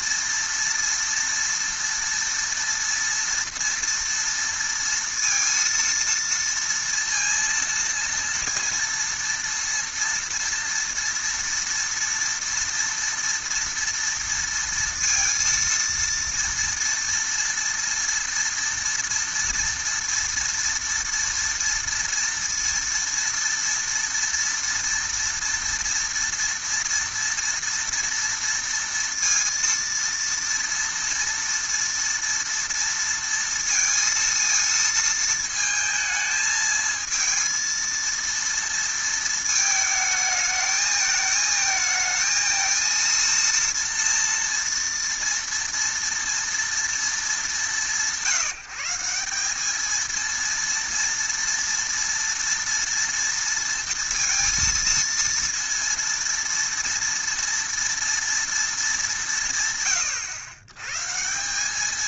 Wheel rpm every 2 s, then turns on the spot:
230, 230, 230, 230, 230, 230, 230, 230, 230, 230, 230, 230, 230, 230, 230, 230, 230, 230, 220, 230, 220, 230, 240, 230, 160, 230, 230, 230, 230, 230, 110.
none